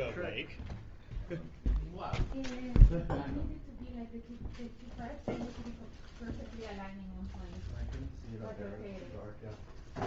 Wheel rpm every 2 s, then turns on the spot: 0, 0, 0, 0, 0.
none